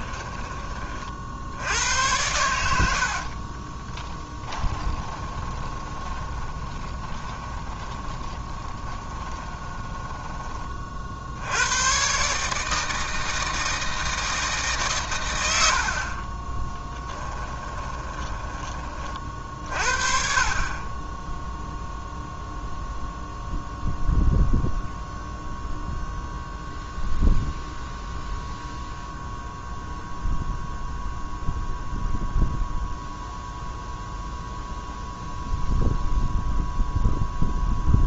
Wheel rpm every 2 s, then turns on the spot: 30, 70, 20, 20, 30, 40, 160, 140, 10, 30, 30, 0, 0, 0, 0, 0, 0, 0, 0.
2-10 16-18